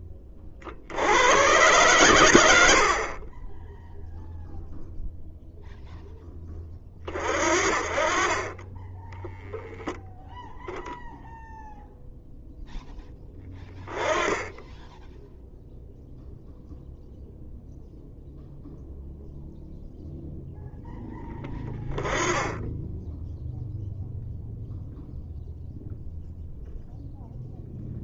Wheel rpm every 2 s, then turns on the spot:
30, 90, 0, 10, 20, 0, 0, 10, 0, 0, 0, 10, 0, 0.
none